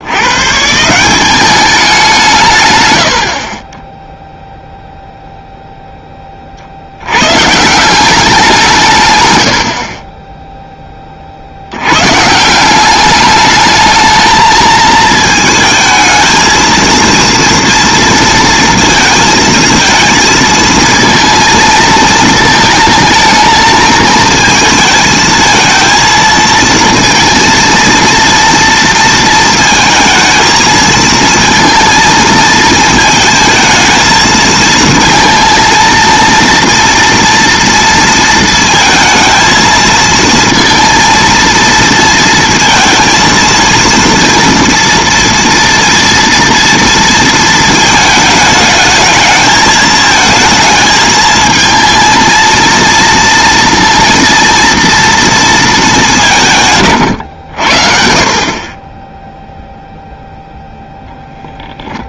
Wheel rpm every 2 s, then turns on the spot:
160, 110, 0, 50, 190, 10, 190, 220, 220, 230, 220, 220, 220, 230, 230, 220, 220, 230, 230, 230, 230, 230, 230, 230, 220, 220, 230, 230, 140, 30, 0.
none